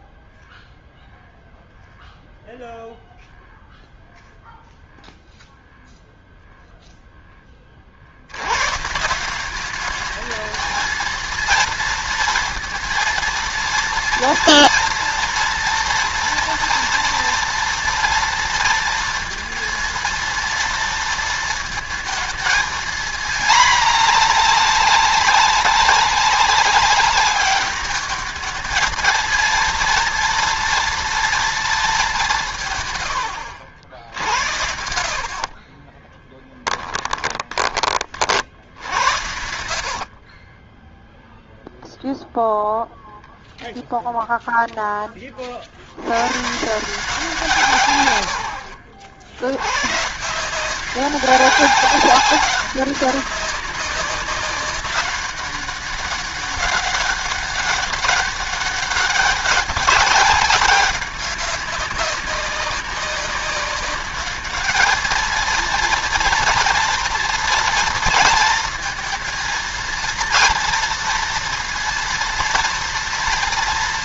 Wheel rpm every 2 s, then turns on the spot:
0, 0, 0, 0, 130, 220, 230, 230, 230, 230, 230, 220, 210, 200, 220, 230, 170, 70, 10, 70, 20, 0, 10, 150, 60, 180, 200, 200, 200, 200, 190, 190, 210, 230, 230, 230, 230.
34-42 48-50